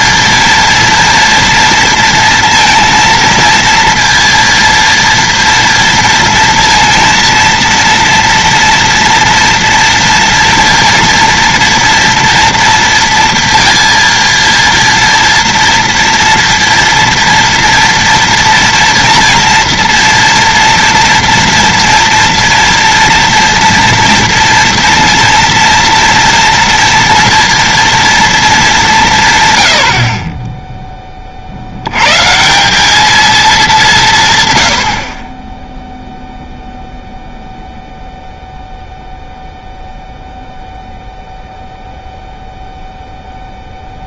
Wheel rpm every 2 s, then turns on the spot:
230, 230, 230, 230, 230, 230, 230, 230, 230, 230, 230, 230, 230, 230, 200, 10, 190, 100, 0, 0, 0, 0.
none